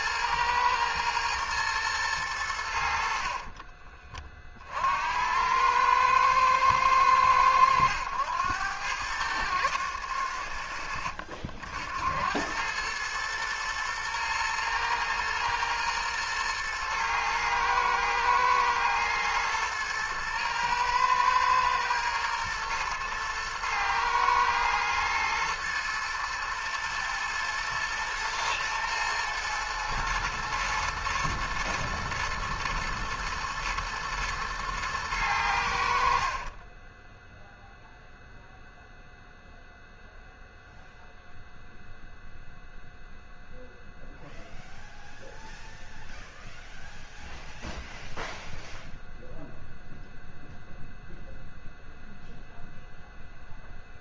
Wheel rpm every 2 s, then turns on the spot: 110, 80, 60, 110, 100, 80, 100, 110, 120, 120, 110, 110, 110, 110, 120, 120, 120, 110, 20, 0, 0, 0, 0, 0, 0, 0, 0.
36-38